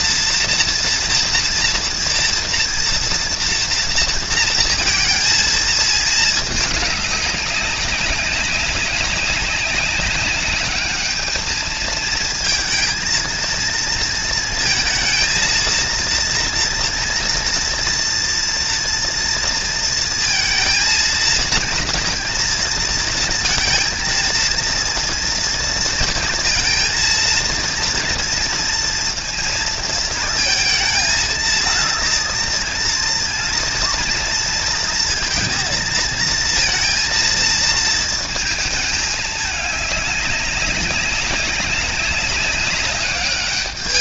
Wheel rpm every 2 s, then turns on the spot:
230, 230, 230, 220, 200, 200, 220, 230, 230, 230, 230, 230, 230, 230, 230, 220, 230, 230, 230, 220, 200, 190.
none